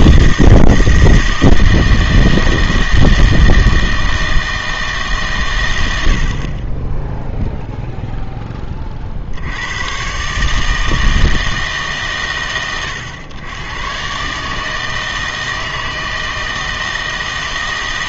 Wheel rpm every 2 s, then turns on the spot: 160, 160, 160, 20, 30, 150, 110, 160, 160.
6-8